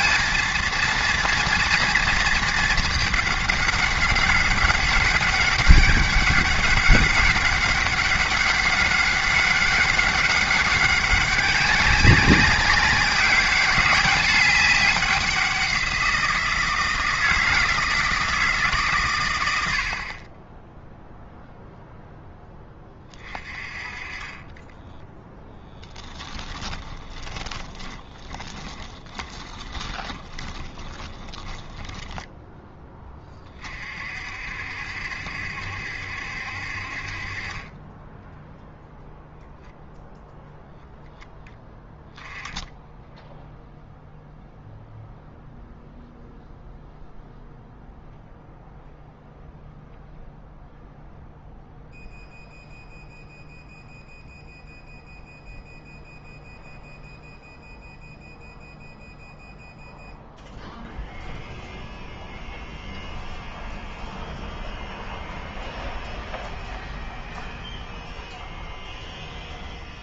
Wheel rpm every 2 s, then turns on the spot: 230, 210, 200, 200, 200, 200, 190, 200, 160, 130, 0, 20, 10, 20, 20, 20, 10, 60, 50, 0, 0, 0, 0, 0, 0, 0, 0, 0, 0, 0, 0, 0, 0, 0, 0.
24-32